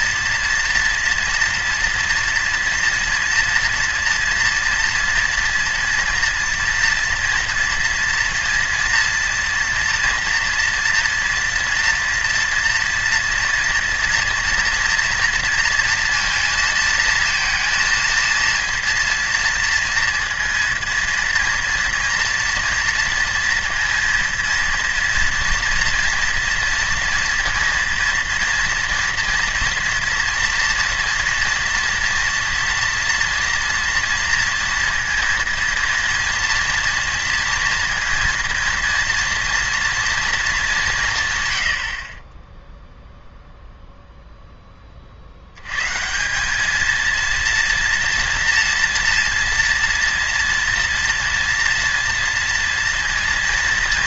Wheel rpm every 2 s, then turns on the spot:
230, 230, 230, 240, 230, 230, 230, 230, 230, 230, 230, 230, 230, 230, 230, 230, 230, 230, 230, 240, 200, 0, 10, 210, 230, 230, 230.
none